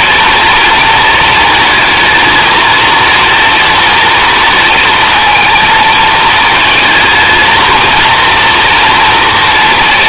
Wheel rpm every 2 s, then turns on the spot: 220, 230, 230, 220, 230.
none